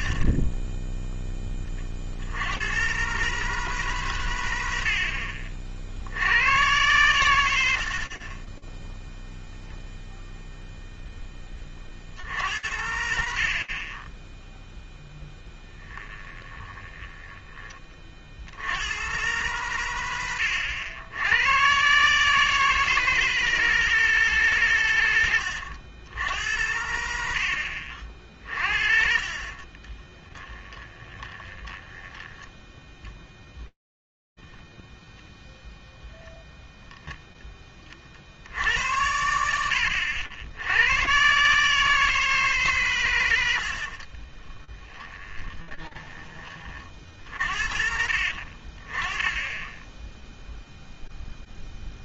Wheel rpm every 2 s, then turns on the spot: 10, 110, 90, 110, 10, 0, 80, 0, 20, 80, 100, 160, 130, 90, 50, 20, 10, 0, 0, 80, 90, 140, 20, 50, 30, 0.
0-2 16-18 26-28 30-34 44-46